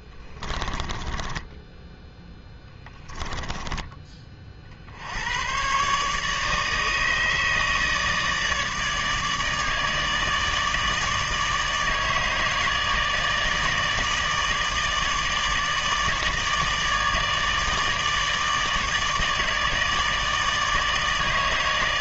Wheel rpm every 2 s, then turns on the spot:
10, 10, 60, 150, 160, 160, 160, 150, 160, 150, 150.
0-4